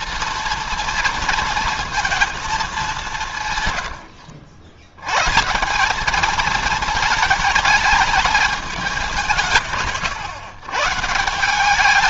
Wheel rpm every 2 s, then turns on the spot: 230, 210, 70, 220, 210, 130.
none